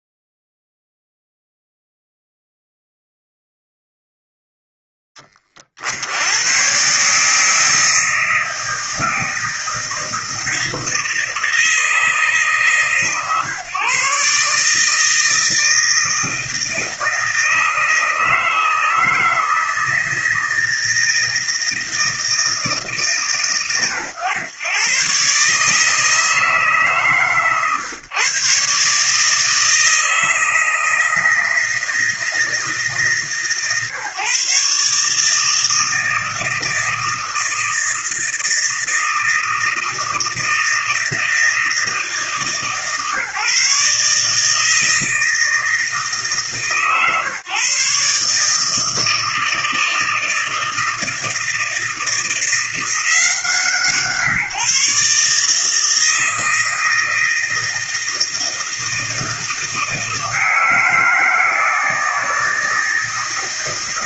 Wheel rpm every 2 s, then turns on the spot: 0, 0, 0, 110, 160, 160, 150, 150, 160, 160, 160, 160, 110, 160, 140, 160, 160, 150, 160, 160, 160, 160, 160, 150, 150, 160, 170, 150, 160, 160, 160, 160.
none